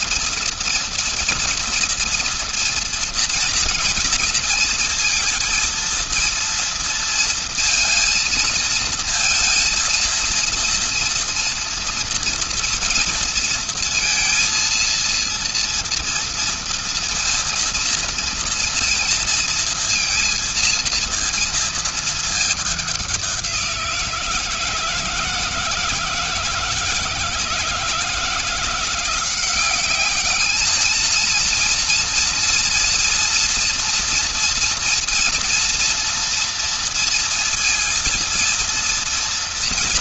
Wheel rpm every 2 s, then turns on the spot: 230, 240, 230, 230, 230, 230, 230, 230, 240, 230, 230, 210, 170, 160, 160, 210, 240, 240, 230, 230.
none